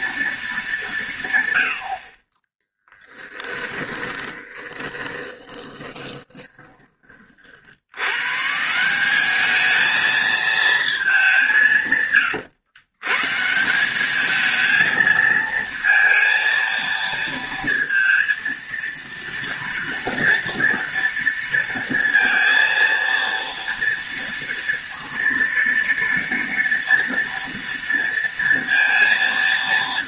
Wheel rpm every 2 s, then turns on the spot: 180, 10, 20, 30, 190, 210, 120, 220, 230, 230, 230, 230, 230, 230, 230.
2-6